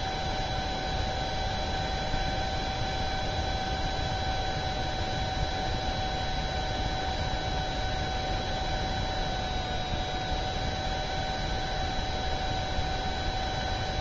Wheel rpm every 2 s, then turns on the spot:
0, 0, 0, 0, 0, 0, 0.
none